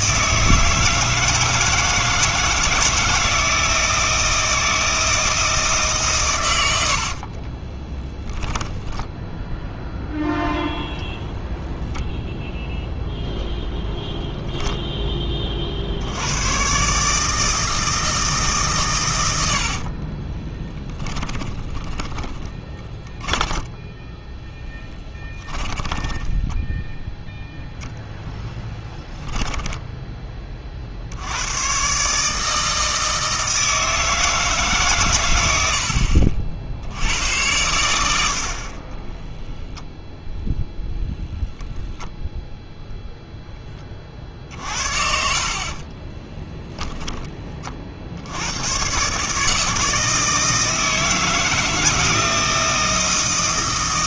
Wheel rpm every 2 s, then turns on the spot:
160, 160, 160, 80, 10, 0, 0, 0, 130, 140, 10, 20, 10, 10, 10, 50, 160, 140, 70, 40, 0, 0, 50, 10, 110, 160, 160.
6-10 20-30 44-48